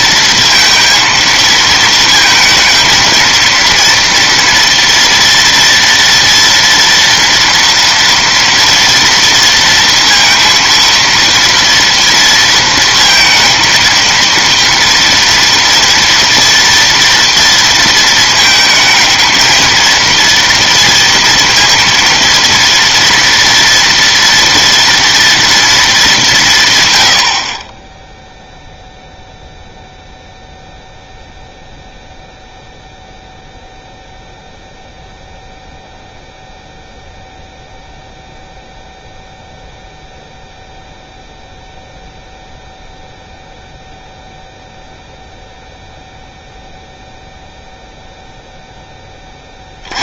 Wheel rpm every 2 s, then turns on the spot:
230, 230, 230, 230, 230, 230, 230, 230, 230, 220, 230, 230, 230, 90, 0, 0, 0, 0, 0, 0, 0, 0, 0, 0, 0.
none